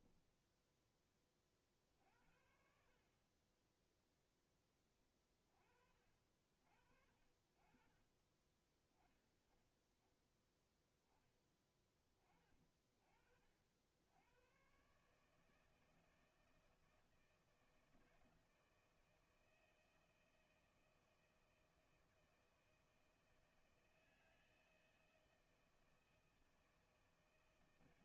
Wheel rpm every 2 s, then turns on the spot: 10, 60, 10, 50, 20, 10, 30, 110, 160, 160, 160, 170, 160, 160.
0-2